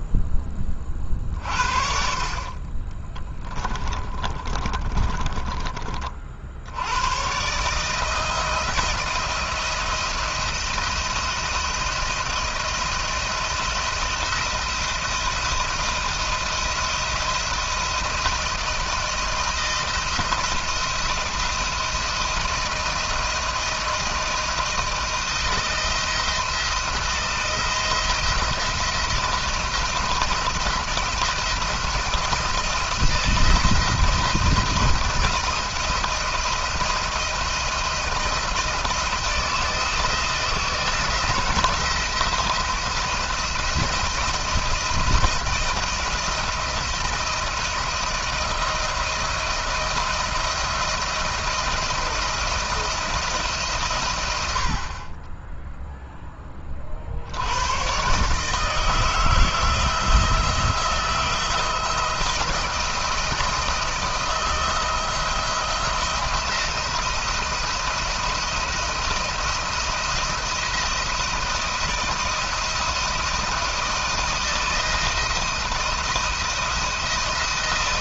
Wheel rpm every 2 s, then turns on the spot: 20, 40, 30, 80, 170, 170, 170, 170, 170, 170, 170, 160, 160, 170, 170, 170, 170, 170, 170, 160, 170, 170, 170, 170, 160, 170, 170, 60, 30, 150, 170, 170, 170, 170, 170, 170, 170, 160, 170.
2-6